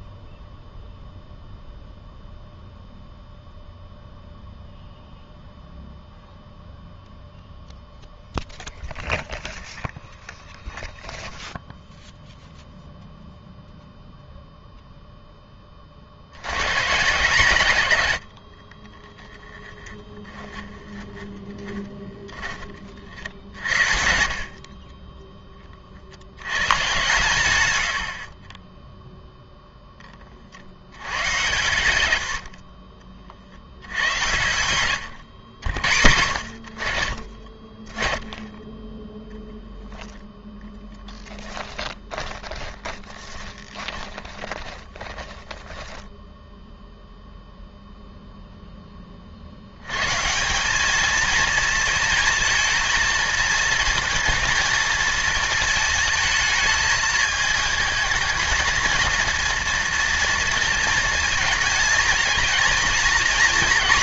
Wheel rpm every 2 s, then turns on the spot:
0, 0, 0, 0, 0, 0, 0, 0, 120, 50, 20, 20, 40, 110, 20, 60, 50, 110, 70, 20, 10, 20, 20, 0, 0, 180, 230, 230, 220, 220, 230, 230.
18-22 32-36 42-46